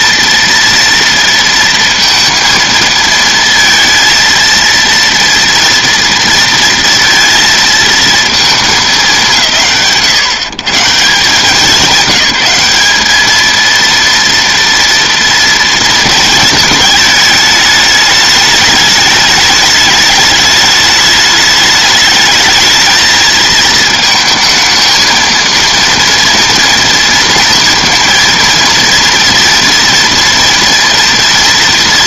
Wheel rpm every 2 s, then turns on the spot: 230, 230, 230, 230, 210, 160, 200, 230, 220, 210, 210, 220, 230, 230, 230, 230.
none